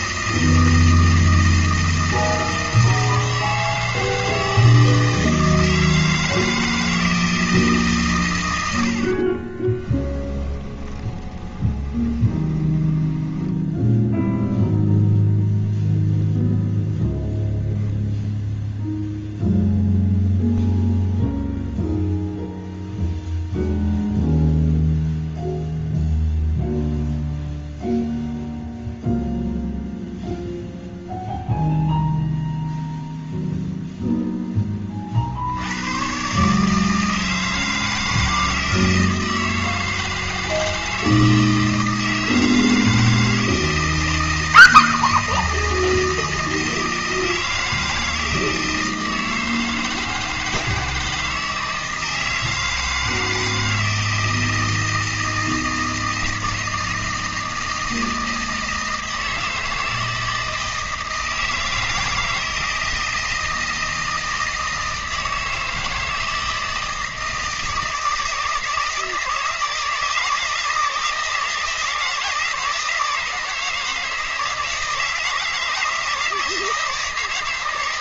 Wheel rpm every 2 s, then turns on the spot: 160, 160, 160, 160, 90, 20, 20, 0, 0, 0, 0, 0, 0, 0, 0, 0, 0, 10, 150, 160, 160, 160, 160, 160, 160, 160, 160, 160, 160, 160, 160, 160, 160, 160, 160, 160, 160, 160, 160.
10-14